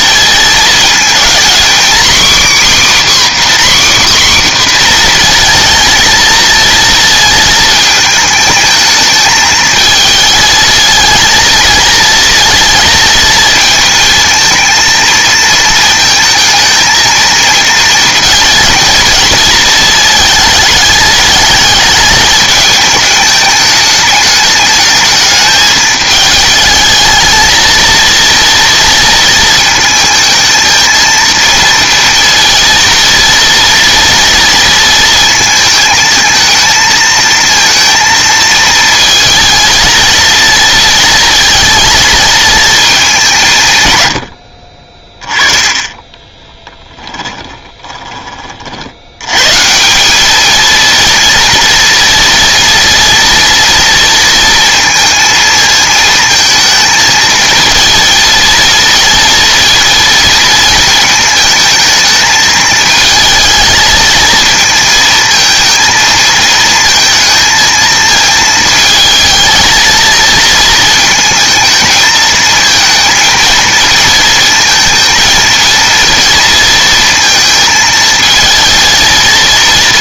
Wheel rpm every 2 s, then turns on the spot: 220, 280, 260, 230, 220, 220, 230, 220, 220, 220, 220, 210, 220, 220, 230, 220, 230, 230, 220, 220, 230, 220, 50, 20, 60, 220, 230, 230, 220, 220, 230, 220, 230, 220, 220, 230, 220, 230, 230, 220.
46-48